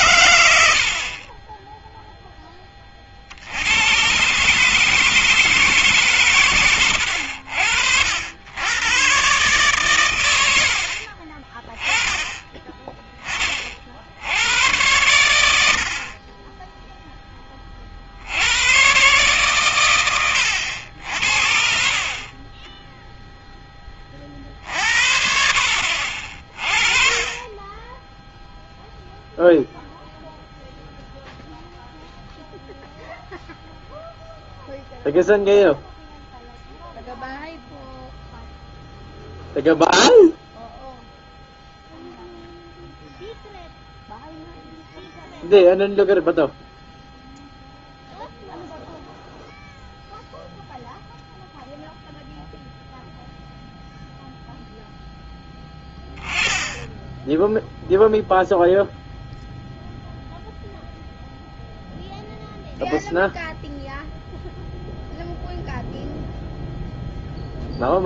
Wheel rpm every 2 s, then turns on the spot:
70, 30, 150, 90, 110, 60, 20, 80, 20, 90, 70, 20, 40, 30, 0, 0, 0, 0, 0, 0, 0, 0, 0, 0, 0, 0, 0, 0, 10, 0, 0, 0, 0, 0.
none